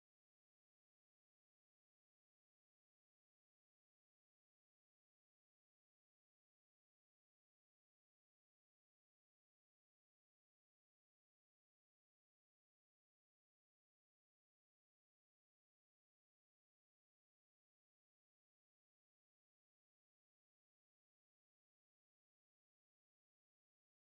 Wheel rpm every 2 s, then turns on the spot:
0, 0, 0, 0, 0, 0, 0, 0, 0, 0, 0, 0.
none